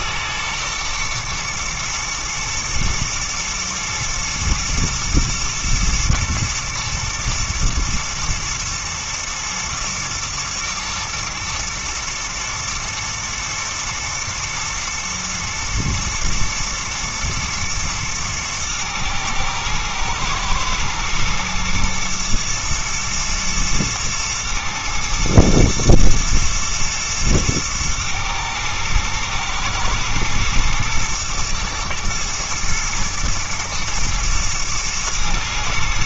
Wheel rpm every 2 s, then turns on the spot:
110, 110, 120, 120, 120, 120, 110, 110, 120, 110, 110, 120, 110, 120, 110, 110, 120, 120.
none